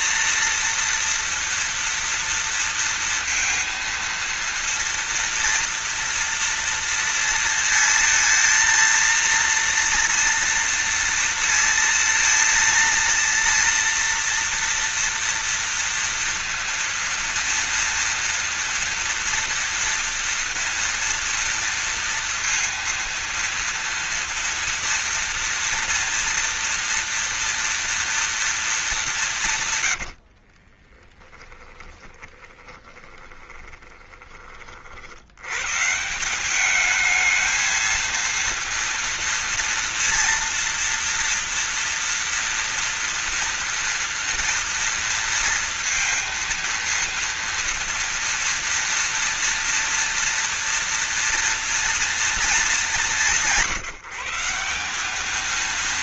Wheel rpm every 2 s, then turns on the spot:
230, 230, 230, 230, 230, 230, 230, 240, 230, 230, 230, 230, 230, 230, 230, 60, 20, 30, 190, 230, 230, 230, 230, 230, 230, 230, 200, 180.
30-34